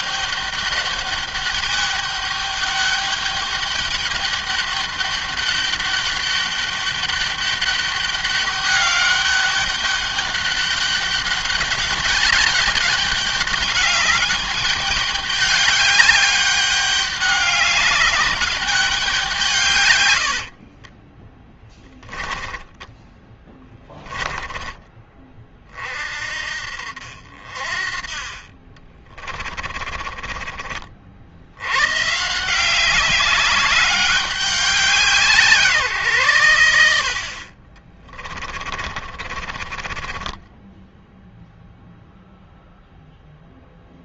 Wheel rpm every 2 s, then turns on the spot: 200, 200, 200, 200, 200, 200, 200, 200, 200, 190, 30, 10, 20, 60, 30, 40, 180, 190, 80, 30, 10, 0.
20-24 28-30 38-42